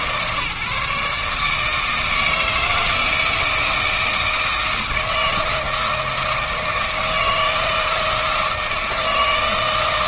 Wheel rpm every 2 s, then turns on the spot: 150, 160, 160, 160, 160.
none